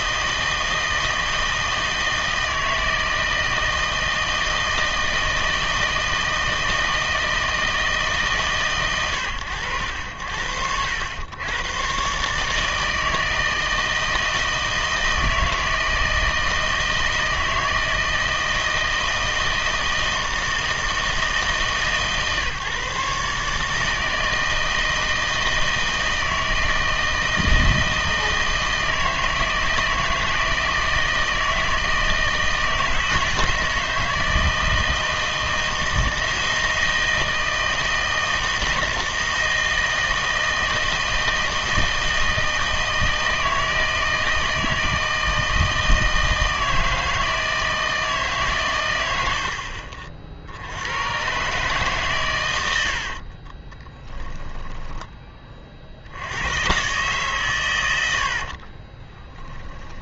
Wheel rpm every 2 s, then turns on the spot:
160, 160, 160, 160, 130, 80, 160, 160, 160, 160, 160, 150, 160, 160, 160, 160, 160, 160, 160, 160, 160, 160, 160, 160, 130, 80, 90, 10, 120, 40.
52-56 58-60